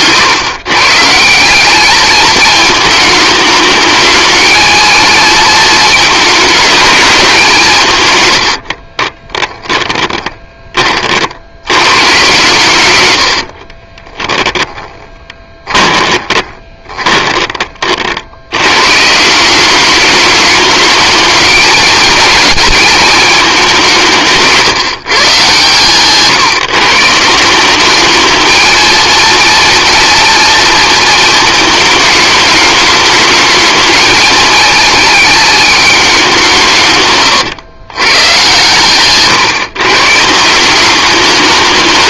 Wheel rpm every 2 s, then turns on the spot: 140, 210, 220, 210, 40, 30, 110, 10, 20, 120, 210, 220, 150, 150, 220, 230, 210, 220, 150, 130, 190.
8-10 14-18